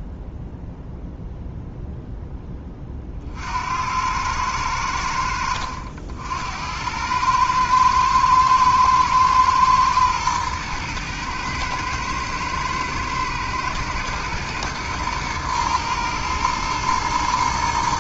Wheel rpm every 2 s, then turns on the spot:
0, 30, 90, 90, 110, 110, 120, 120, 110.
none